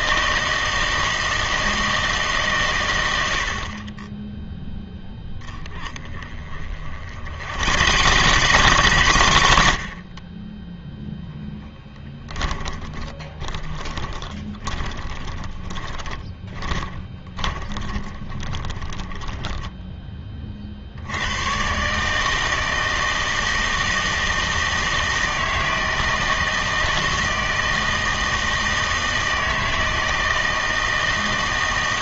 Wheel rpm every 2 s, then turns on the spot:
160, 120, 0, 40, 120, 20, 20, 20, 20, 20, 50, 160, 160, 160, 160, 160.
6-20